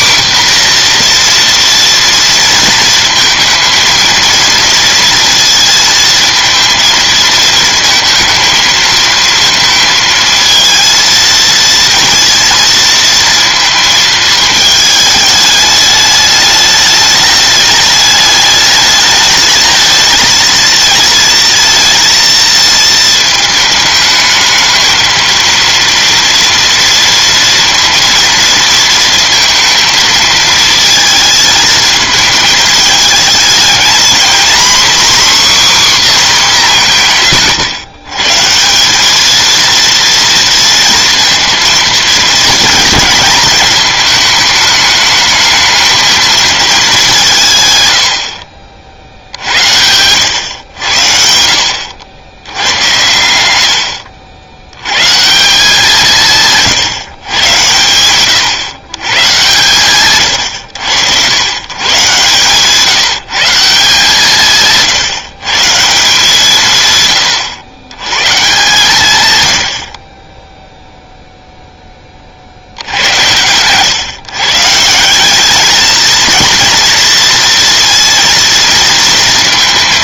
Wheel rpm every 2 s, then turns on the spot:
240, 230, 230, 220, 220, 220, 230, 210, 210, 220, 220, 220, 230, 230, 230, 220, 220, 260, 150, 200, 230, 220, 220, 190, 60, 80, 100, 110, 140, 130, 100, 160, 160, 140, 140, 0, 80, 170, 230, 230.
none